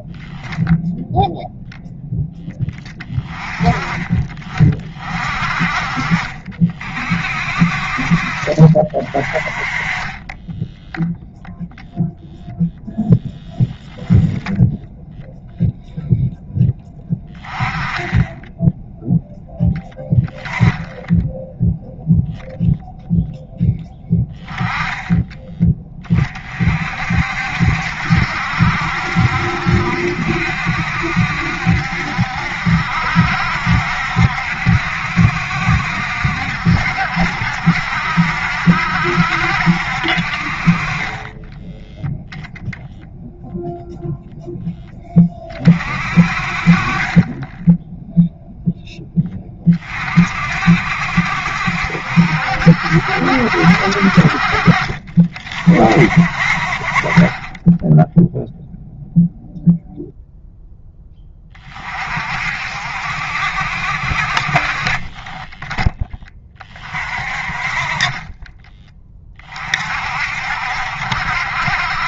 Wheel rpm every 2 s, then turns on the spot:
0, 20, 40, 50, 40, 10, 0, 0, 10, 10, 10, 0, 10, 40, 70, 70, 60, 70, 70, 70, 40, 0, 10, 30, 0, 50, 60, 40, 40, 0, 0, 60, 40, 30, 20, 60.
none